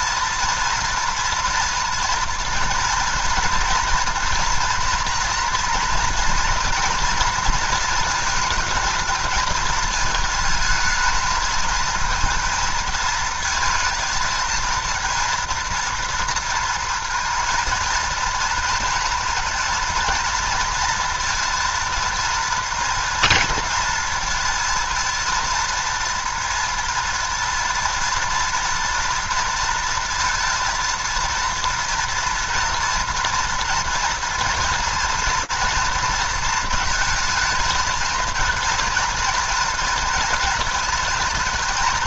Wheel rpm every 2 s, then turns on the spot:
230, 230, 240, 240, 230, 220, 220, 230, 230, 230, 230, 230, 230, 240, 230, 230, 230, 230, 230, 230, 230.
none